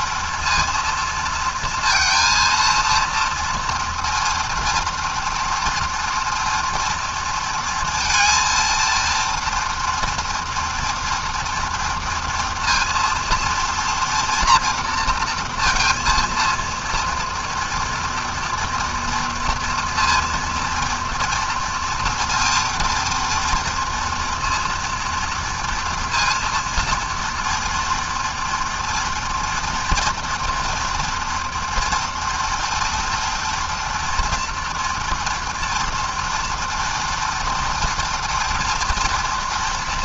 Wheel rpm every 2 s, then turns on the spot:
230, 230, 230, 230, 230, 230, 230, 230, 230, 230, 230, 230, 230, 240, 230, 240, 230, 230, 230, 230.
none